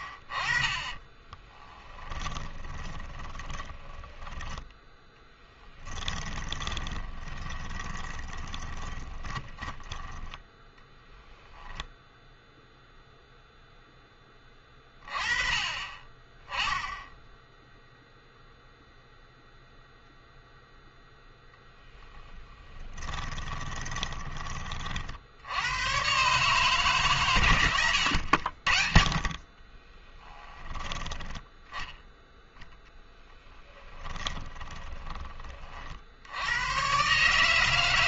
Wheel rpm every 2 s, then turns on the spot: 30, 20, 10, 30, 20, 10, 0, 20, 20, 0, 0, 20, 30, 150, 70, 10, 10, 20, 110.
2-4 6-10 22-24 28-30 34-36